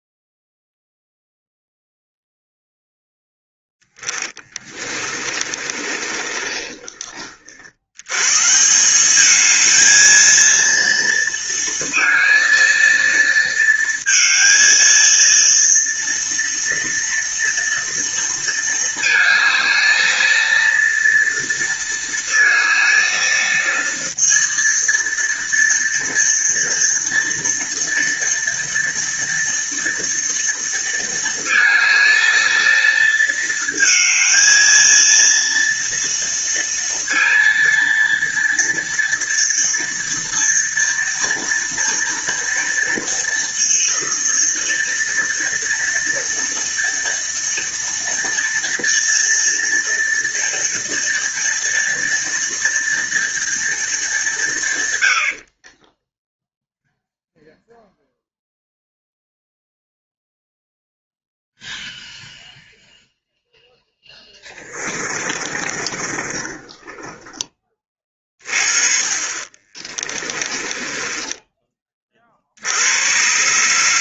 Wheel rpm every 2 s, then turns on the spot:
0, 0, 20, 30, 170, 230, 230, 220, 230, 230, 230, 230, 230, 230, 230, 230, 220, 230, 230, 230, 230, 230, 230, 230, 230, 230, 230, 140, 0, 0, 0, 0, 20, 20, 30, 20, 80.
4-8 64-68 70-72